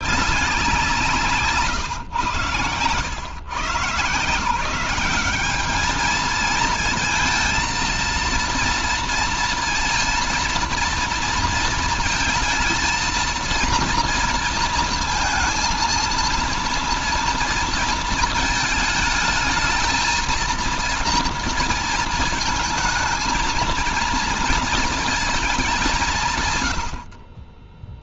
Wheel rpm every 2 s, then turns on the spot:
190, 110, 170, 220, 230, 230, 220, 230, 230, 220, 230, 230, 230, 110.
none